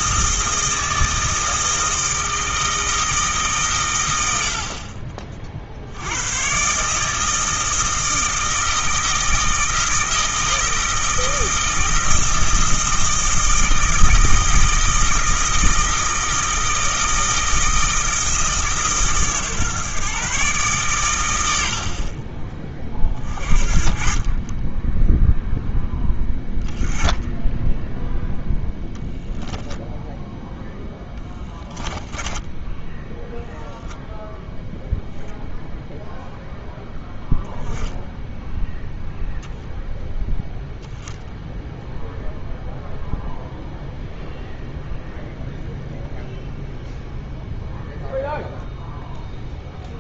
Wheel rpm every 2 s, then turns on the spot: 160, 160, 50, 140, 160, 160, 160, 160, 160, 150, 130, 30, 20, 0, 0, 0, 0, 0, 0, 0, 0, 0, 0, 0, 0.
none